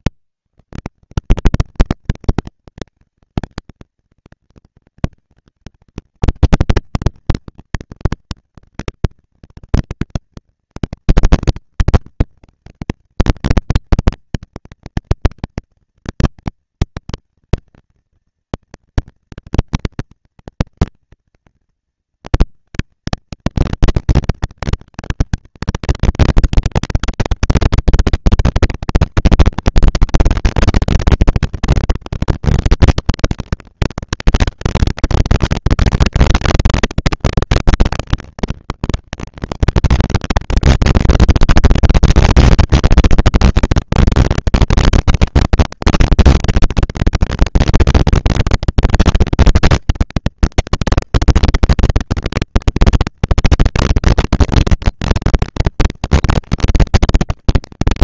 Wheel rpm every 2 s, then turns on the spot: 130, 230, 230, 230, 230, 230, 230, 230, 230, 230, 230, 230, 230, 210, 200, 210, 230, 230, 230, 230, 230, 230, 230, 230, 230, 230, 230, 230, 220.
none